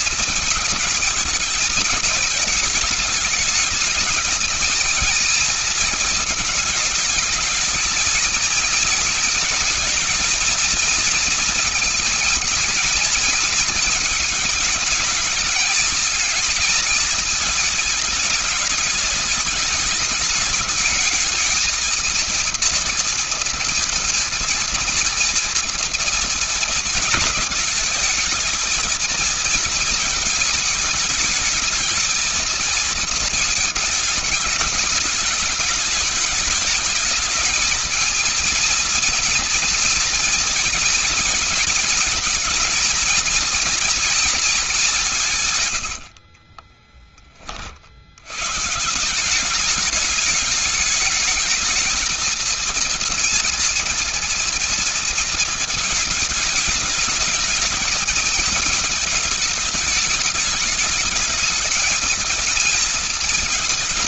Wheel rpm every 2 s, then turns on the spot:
220, 210, 230, 220, 220, 230, 220, 220, 220, 210, 210, 230, 230, 220, 230, 220, 220, 210, 210, 230, 230, 230, 190, 20, 170, 210, 230, 230, 220, 210, 210, 220.
none